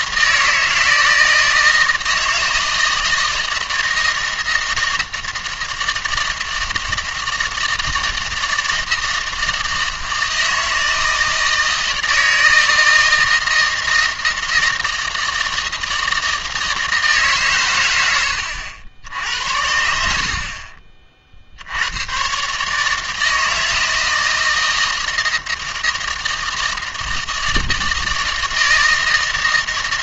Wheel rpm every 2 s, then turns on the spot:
160, 160, 160, 160, 160, 160, 160, 160, 160, 90, 30, 150, 160, 160, 160.
none